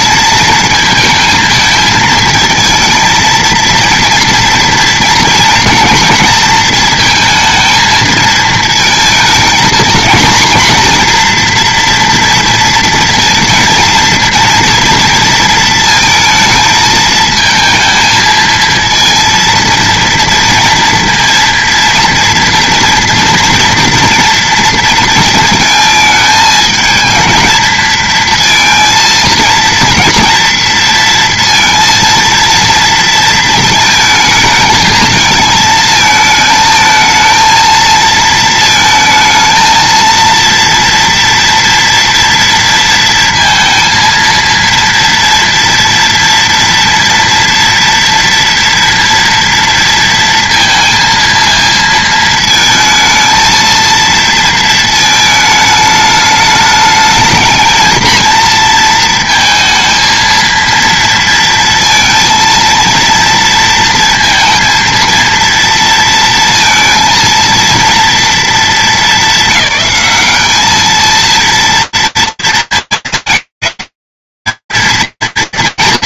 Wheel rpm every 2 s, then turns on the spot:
220, 230, 230, 230, 230, 240, 230, 240, 220, 230, 230, 240, 230, 220, 230, 230, 230, 220, 220, 220, 230, 230, 230, 230, 230, 230, 220, 230, 210, 230, 230, 230, 230, 230, 220, 210, 220, 210.
none